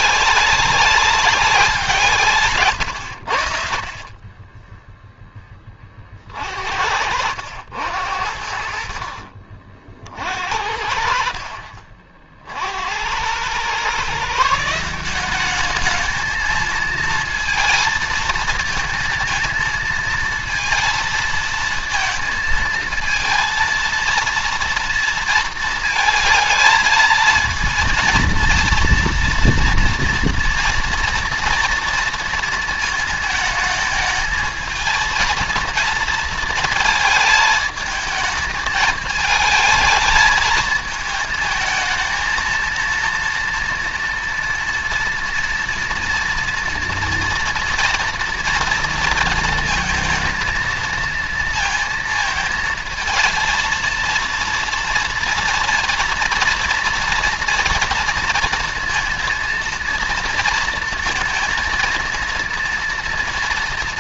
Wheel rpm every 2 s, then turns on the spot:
200, 120, 10, 60, 60, 50, 60, 170, 230, 220, 220, 220, 230, 220, 230, 230, 230, 220, 220, 220, 220, 230, 230, 230, 230, 230, 230, 230, 240, 230, 230, 230.
6-8